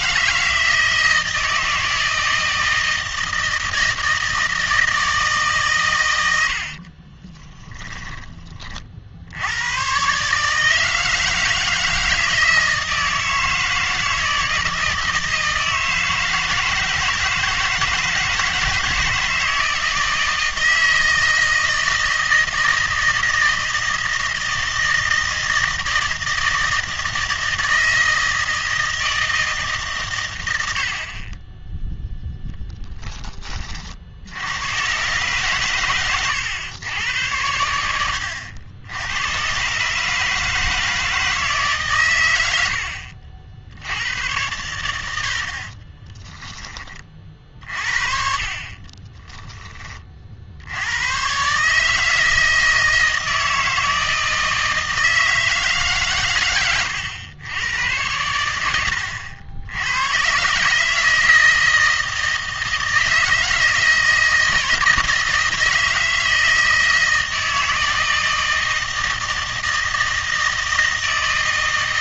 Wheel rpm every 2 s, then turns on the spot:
160, 160, 160, 70, 40, 160, 160, 160, 160, 160, 160, 160, 160, 160, 160, 80, 10, 110, 110, 90, 160, 90, 100, 20, 40, 80, 160, 160, 110, 90, 140, 160, 160, 160, 160, 160.
6-8